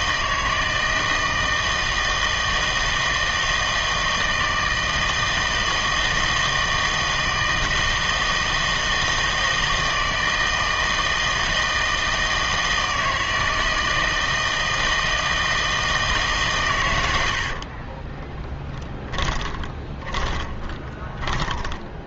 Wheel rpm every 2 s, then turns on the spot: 160, 160, 160, 160, 160, 160, 160, 160, 120, 20, 20.
18-22